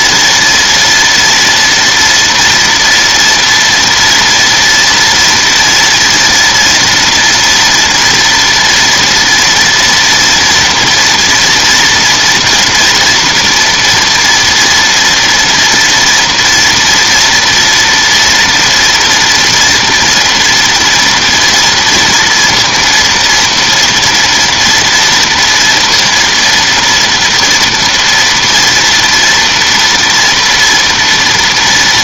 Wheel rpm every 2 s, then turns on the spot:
230, 230, 230, 230, 230, 230, 230, 230, 230, 240, 240, 230, 230, 230, 230, 230.
none